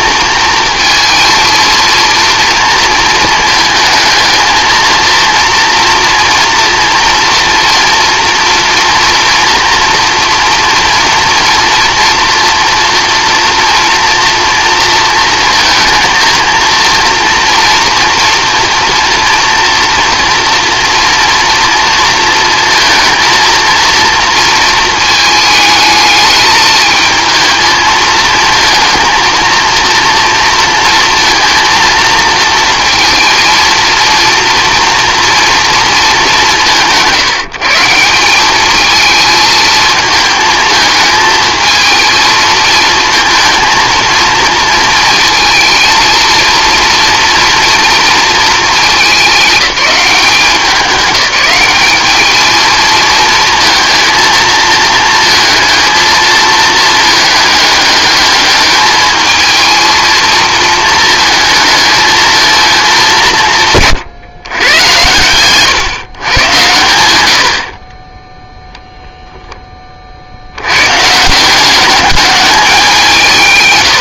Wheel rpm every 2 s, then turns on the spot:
230, 230, 220, 240, 240, 240, 230, 230, 230, 230, 230, 230, 220, 220, 230, 230, 230, 230, 180, 200, 220, 220, 220, 230, 220, 190, 220, 230, 220, 210, 220, 210, 110, 110, 0, 100, 200.
none